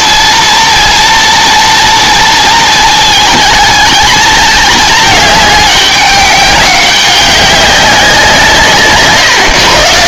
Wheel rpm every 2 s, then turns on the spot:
230, 230, 210, 200, 170.
none